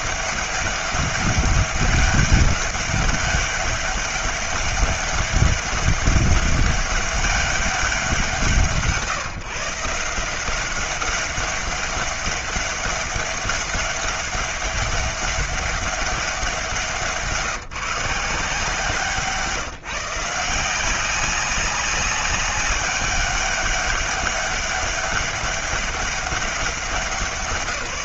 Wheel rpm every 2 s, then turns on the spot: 200, 200, 200, 200, 150, 190, 200, 200, 170, 170, 180, 200, 200, 180.
none